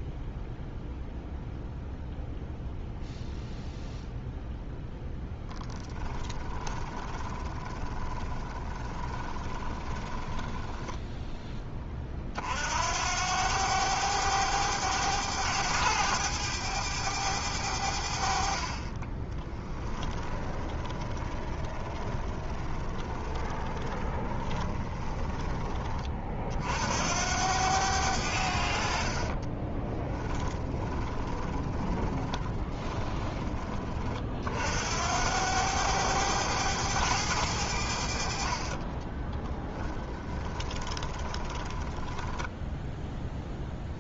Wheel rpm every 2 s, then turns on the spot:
0, 0, 0, 10, 20, 10, 80, 100, 100, 30, 20, 20, 20, 70, 60, 30, 20, 70, 100, 30, 20, 0.
6-12 18-26 28-34 38-42